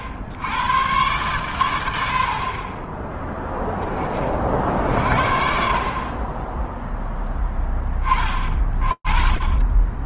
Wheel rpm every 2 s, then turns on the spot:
110, 70, 40, 20, 30.
none